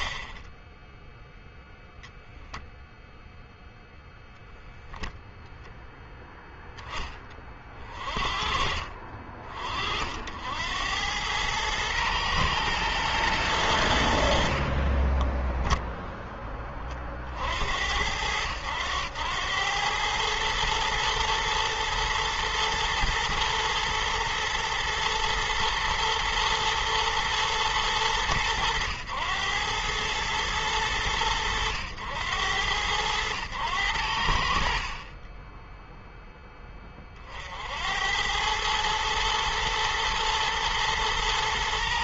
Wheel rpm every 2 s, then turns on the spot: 0, 0, 0, 30, 40, 100, 100, 0, 70, 100, 110, 120, 110, 110, 100, 90, 100, 30, 50, 110, 120.
none